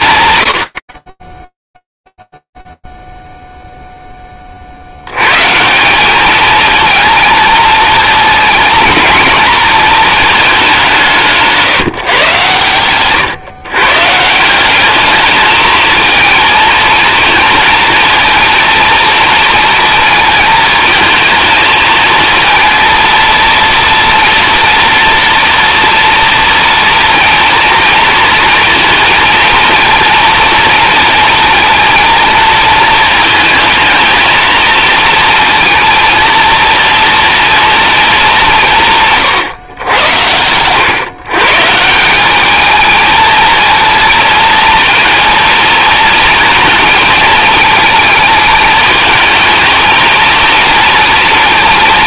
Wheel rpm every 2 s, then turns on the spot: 80, 0, 40, 220, 230, 210, 130, 180, 230, 230, 220, 230, 230, 230, 230, 230, 230, 230, 230, 180, 110, 210, 230, 230, 220, 230.
12-14 40-42